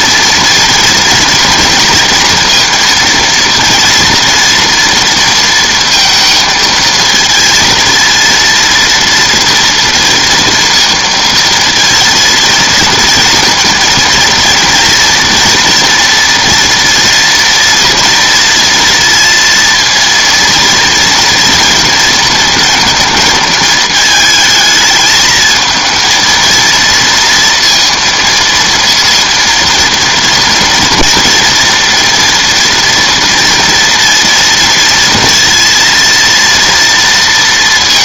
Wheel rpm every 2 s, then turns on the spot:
230, 230, 230, 220, 230, 230, 230, 230, 230, 230, 230, 230, 220, 230, 230, 230, 230, 230, 230.
none